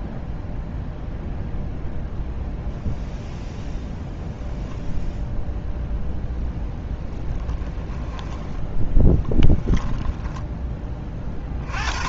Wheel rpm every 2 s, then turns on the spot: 0, 0, 0, 10, 10, 20.
6-10